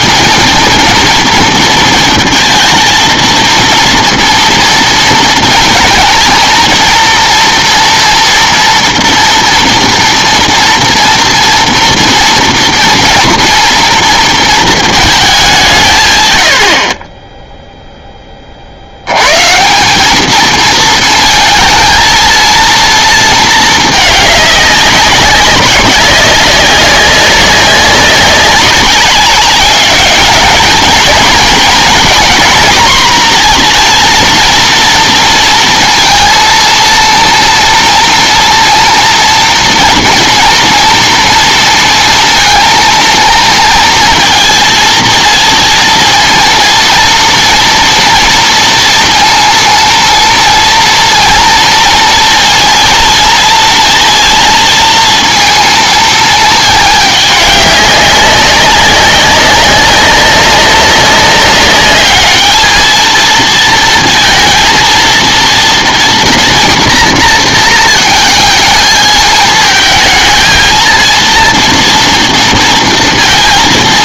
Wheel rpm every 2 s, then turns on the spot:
230, 230, 230, 230, 230, 240, 230, 230, 70, 50, 220, 230, 200, 190, 190, 220, 240, 230, 230, 230, 230, 230, 230, 230, 230, 230, 230, 230, 210, 190, 190, 220, 230, 240, 220, 230, 230.
none